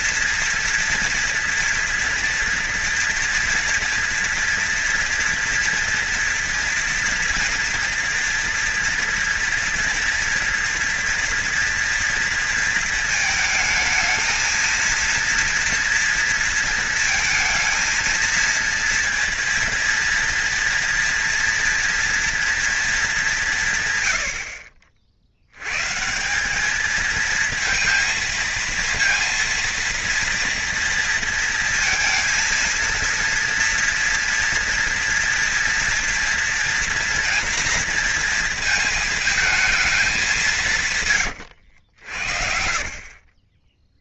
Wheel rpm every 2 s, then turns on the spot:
230, 230, 230, 230, 240, 240, 230, 230, 230, 230, 230, 220, 60, 210, 230, 230, 230, 230, 240, 220, 160, 50.
42-44